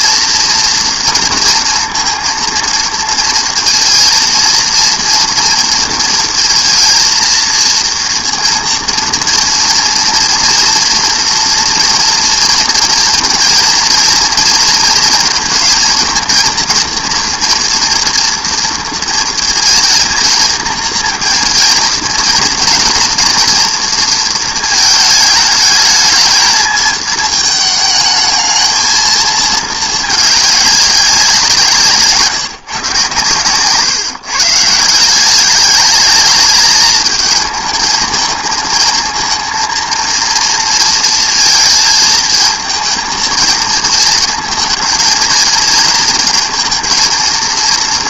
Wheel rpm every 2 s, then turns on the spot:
230, 230, 230, 230, 230, 240, 230, 230, 240, 230, 230, 230, 220, 220, 220, 210, 150, 150, 210, 220, 230, 220, 220, 230.
none